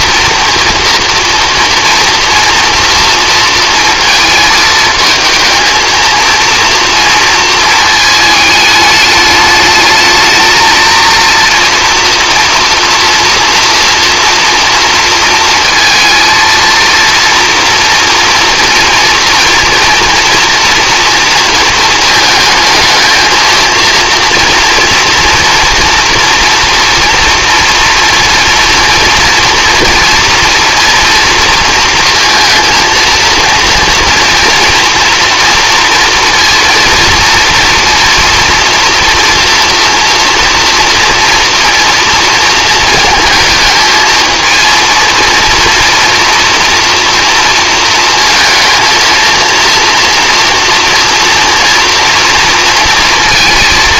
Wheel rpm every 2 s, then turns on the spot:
230, 230, 220, 230, 210, 230, 230, 230, 230, 240, 230, 220, 230, 240, 240, 230, 230, 230, 230, 230, 230, 230, 230, 230, 230, 230, 230.
none